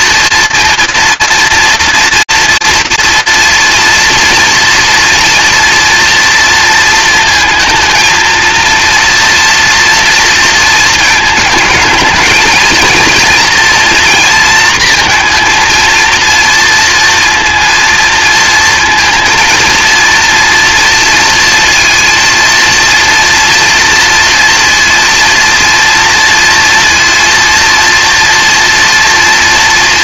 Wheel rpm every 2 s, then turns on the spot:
230, 230, 230, 230, 230, 220, 230, 230, 230, 230, 230, 230, 230, 230, 240.
none